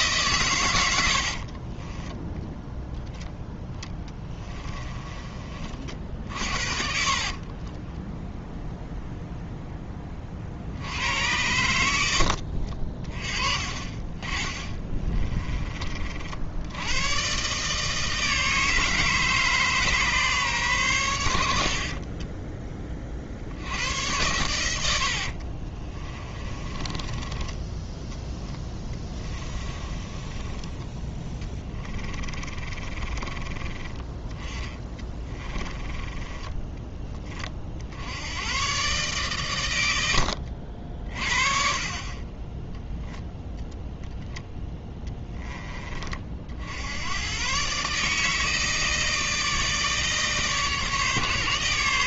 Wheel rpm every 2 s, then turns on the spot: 100, 0, 20, 40, 0, 80, 40, 20, 100, 160, 110, 20, 90, 20, 10, 10, 30, 20, 20, 130, 60, 10, 20, 80, 160, 150.
6-8 14-16 24-30 32-36